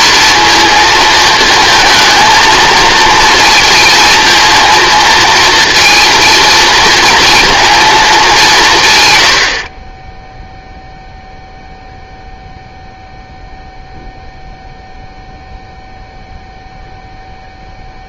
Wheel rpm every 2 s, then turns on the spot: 230, 230, 230, 230, 150, 0, 0, 0, 0.
none